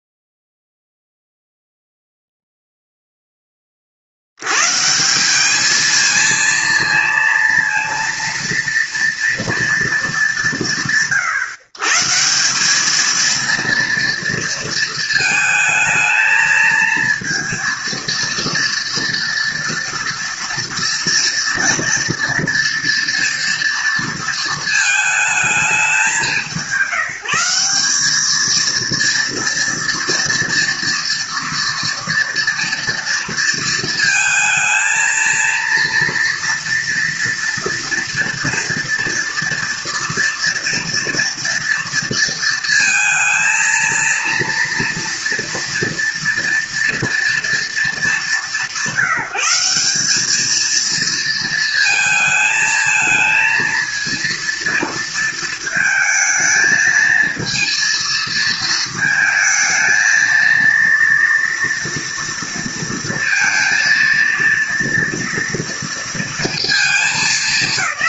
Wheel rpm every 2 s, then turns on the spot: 0, 0, 110, 230, 230, 120, 190, 230, 220, 230, 230, 230, 230, 170, 220, 230, 230, 220, 230, 230, 230, 230, 230, 240, 190, 220, 220, 230, 220, 220, 230, 230, 230, 220.
none